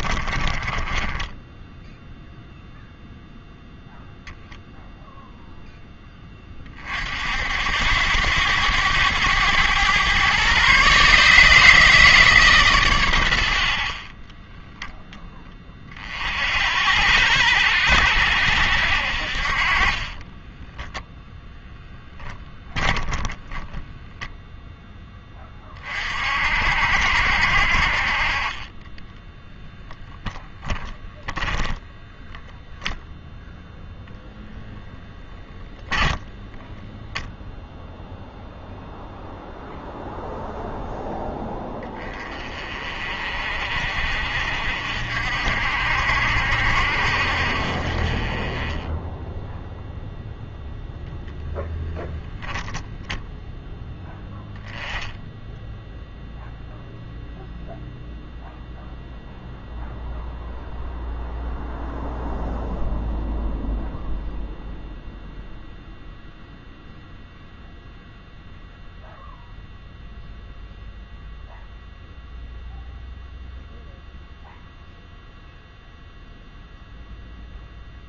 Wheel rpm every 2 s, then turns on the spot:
20, 0, 0, 30, 100, 130, 140, 10, 70, 70, 10, 10, 0, 60, 30, 10, 0, 0, 10, 0, 0, 30, 50, 60, 20, 0, 0, 0, 0, 0, 0, 0, 0, 0, 0, 0, 0, 0, 0.
0-2 20-24 28-30